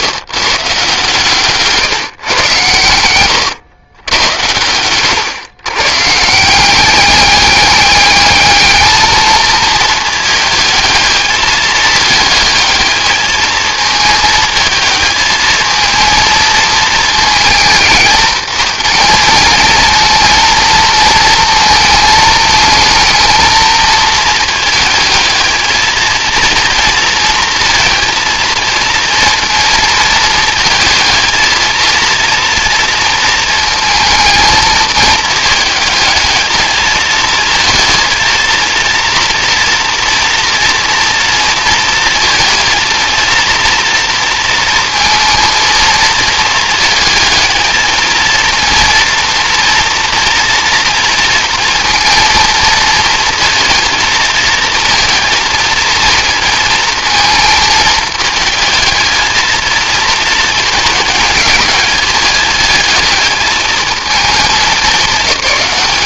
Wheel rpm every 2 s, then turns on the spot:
120, 110, 110, 190, 220, 220, 220, 220, 220, 230, 230, 220, 220, 230, 230, 220, 230, 220, 220, 230, 230, 230, 230, 220, 230, 230, 230, 220, 230, 220, 210, 210, 220.
none